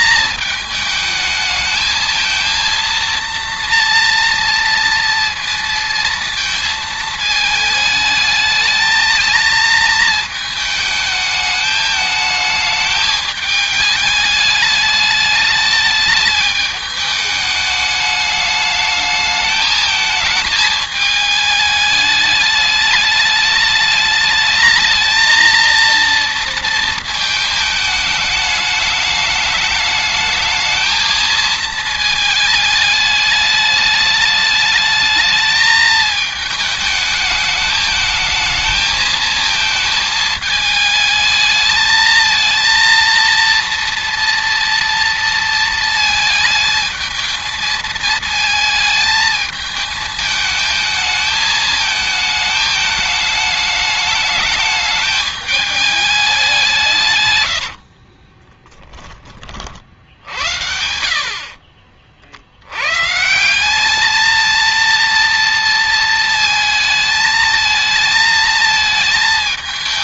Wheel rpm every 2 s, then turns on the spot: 230, 230, 220, 220, 220, 210, 210, 210, 210, 220, 210, 220, 230, 210, 220, 210, 210, 210, 220, 220, 220, 230, 220, 220, 220, 220, 210, 200, 30, 70, 50, 220, 230, 220, 220.
56-58